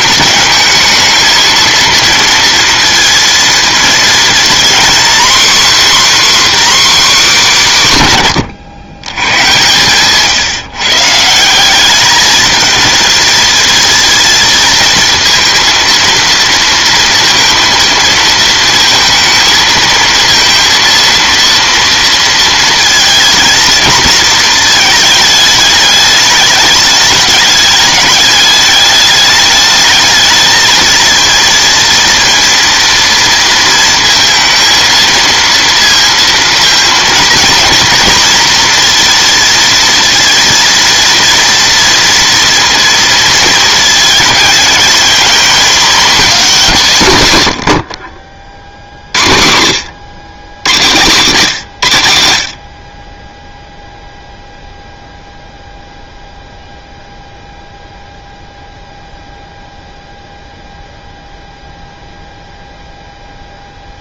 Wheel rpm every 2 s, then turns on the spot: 220, 230, 250, 280, 120, 140, 220, 220, 230, 230, 230, 230, 220, 210, 200, 220, 230, 230, 230, 230, 230, 230, 220, 210, 50, 110, 50, 0, 0, 0, 0, 0.
none